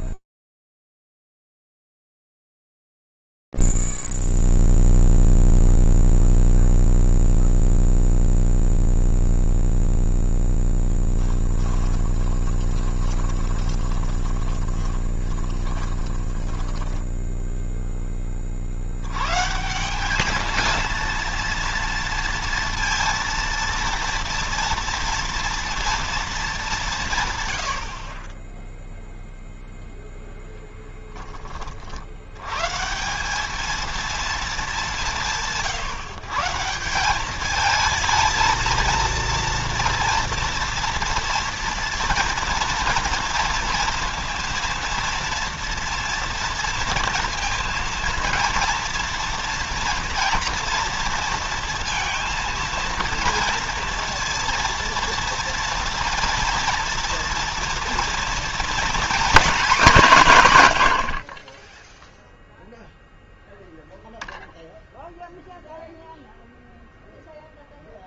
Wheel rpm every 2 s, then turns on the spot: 0, 0, 0, 0, 0, 0, 20, 20, 20, 40, 210, 230, 230, 190, 10, 0, 140, 210, 160, 220, 230, 230, 230, 230, 240, 230, 230, 230, 230, 230, 140, 0, 0, 0.
12-18